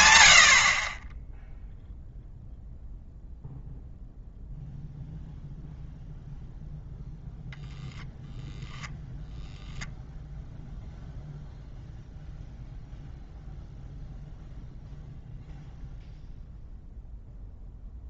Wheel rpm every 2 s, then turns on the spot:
10, 0, 0, 0, 10, 0, 0, 0, 0.
none